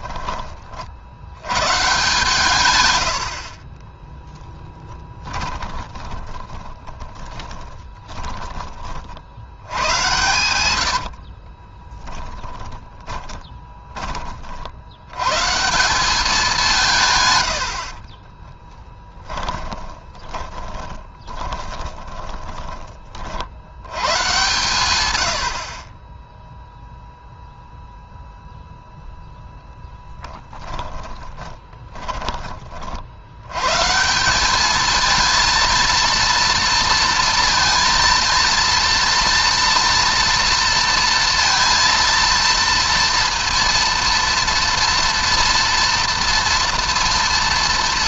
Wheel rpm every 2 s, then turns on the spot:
40, 90, 10, 20, 30, 80, 20, 80, 170, 10, 20, 30, 120, 0, 0, 10, 40, 220, 230, 230, 230, 230, 230, 230.
2-8 10-14 18-22 30-32